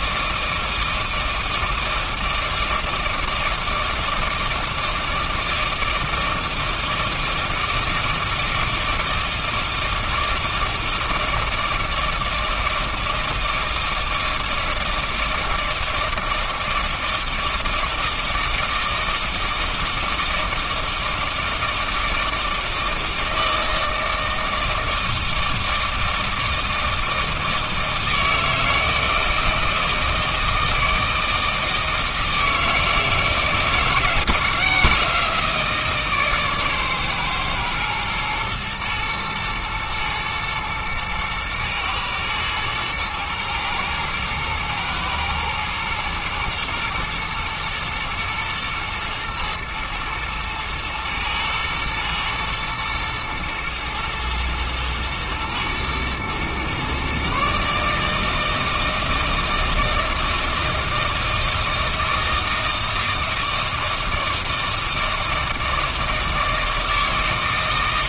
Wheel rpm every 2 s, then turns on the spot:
160, 160, 160, 160, 160, 160, 160, 160, 160, 160, 160, 160, 160, 160, 160, 160, 160, 160, 140, 110, 110, 110, 120, 120, 120, 110, 110, 110, 120, 160, 160, 160, 160, 160.
none